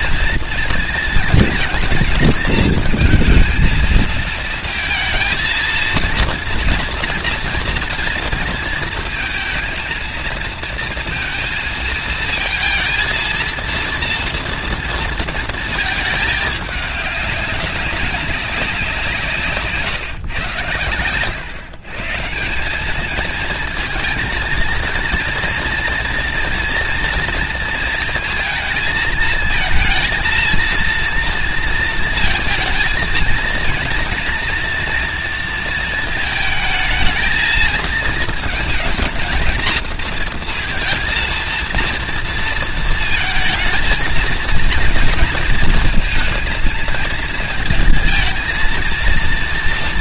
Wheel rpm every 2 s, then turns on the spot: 230, 230, 230, 230, 230, 230, 230, 230, 200, 170, 120, 210, 230, 230, 220, 230, 230, 230, 220, 220, 230, 230, 230, 230, 230.
none